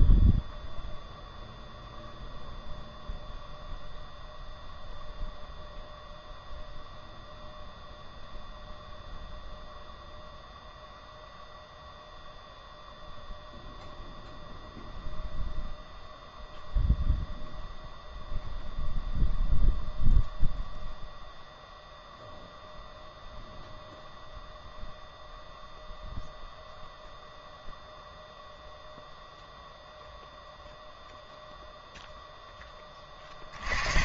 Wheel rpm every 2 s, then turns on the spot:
0, 0, 0, 0, 0, 0, 0, 0, 0, 0, 0, 0, 0, 0, 0, 0, 10.
none